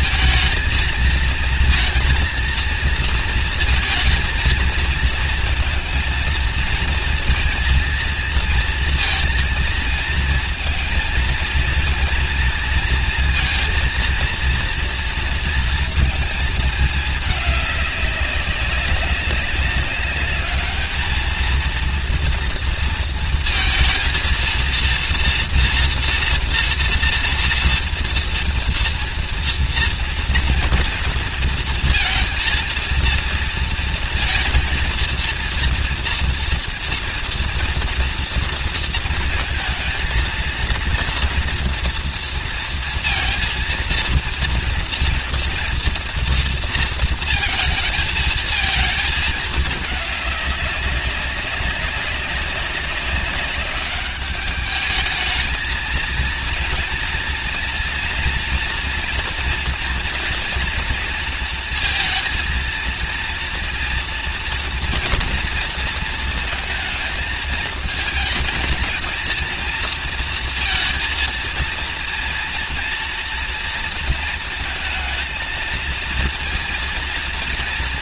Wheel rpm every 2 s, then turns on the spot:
230, 230, 230, 230, 230, 230, 230, 230, 220, 200, 210, 230, 230, 230, 230, 230, 230, 230, 230, 230, 230, 230, 230, 230, 220, 200, 190, 210, 230, 240, 240, 220, 230, 220, 220, 230, 230, 230, 230.
none